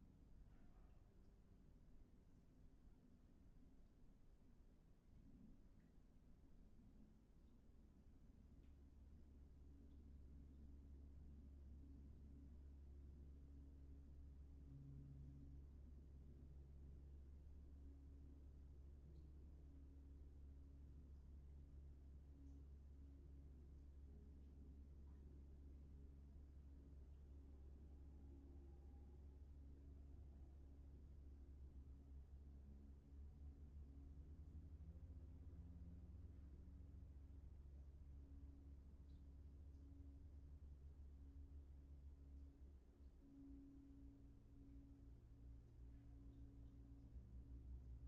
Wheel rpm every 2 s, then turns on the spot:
0, 0, 0, 0, 0, 0, 0, 0, 0, 0, 0, 0, 0, 0, 0, 0, 0, 0, 0, 0, 0, 0, 0, 0.
none